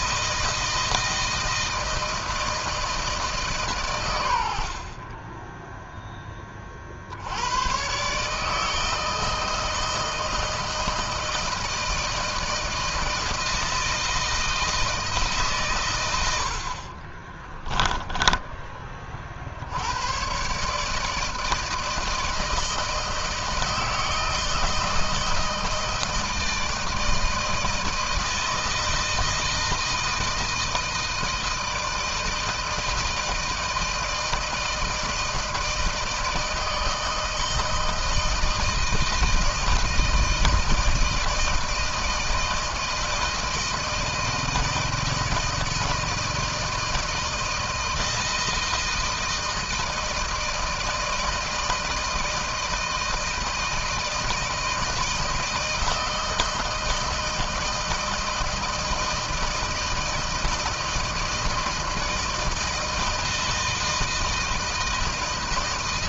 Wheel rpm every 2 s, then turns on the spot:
160, 160, 80, 30, 150, 160, 160, 160, 70, 10, 140, 160, 160, 160, 160, 160, 160, 160, 160, 160, 160, 160, 160, 160, 160, 160, 160, 170, 160, 160, 160, 160, 160.
16-18